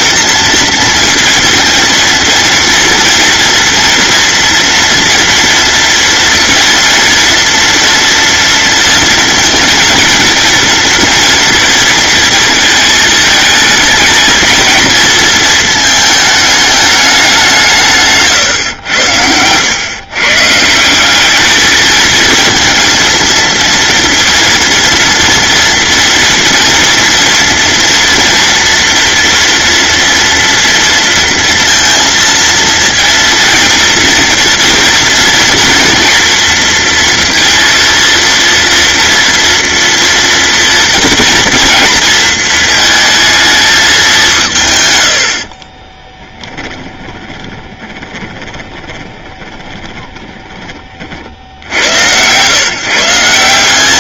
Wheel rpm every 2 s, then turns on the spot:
230, 230, 230, 230, 230, 230, 220, 230, 210, 100, 180, 230, 230, 230, 230, 230, 230, 230, 230, 230, 240, 220, 130, 20, 20, 40, 160.
46-50